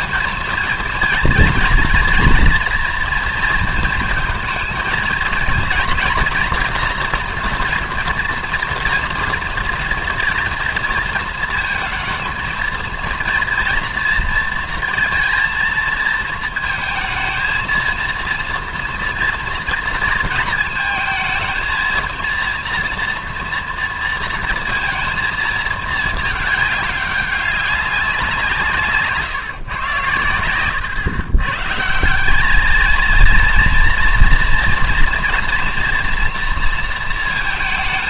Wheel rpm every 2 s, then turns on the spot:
220, 240, 230, 240, 230, 240, 230, 230, 220, 230, 220, 230, 230, 200, 160, 100, 210, 230, 230.
none